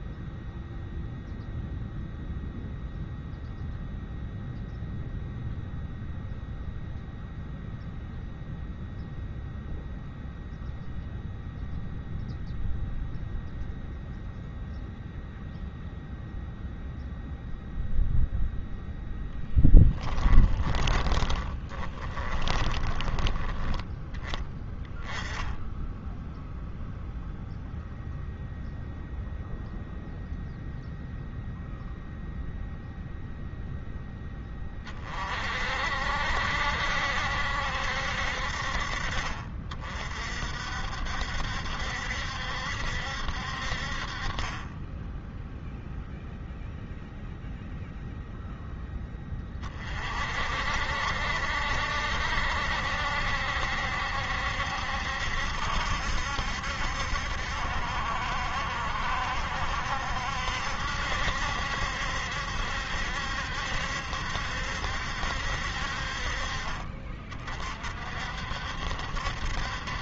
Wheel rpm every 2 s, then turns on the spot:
0, 0, 0, 0, 0, 0, 0, 0, 0, 0, 20, 20, 20, 0, 0, 0, 0, 30, 70, 50, 60, 70, 10, 0, 10, 60, 70, 70, 70, 70, 70, 70, 70, 40, 70.
20-24